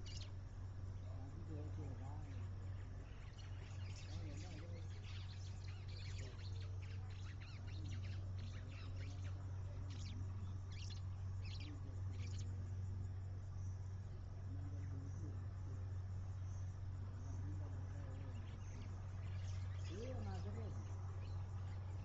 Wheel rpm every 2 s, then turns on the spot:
0, 0, 0, 0, 0, 0, 0, 0, 0, 0, 0.
none